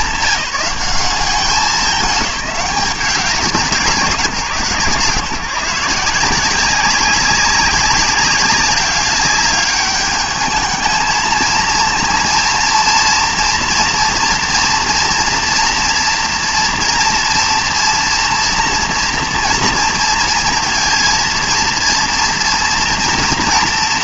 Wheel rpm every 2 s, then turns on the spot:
190, 200, 150, 180, 200, 220, 230, 230, 230, 230, 220, 230.
none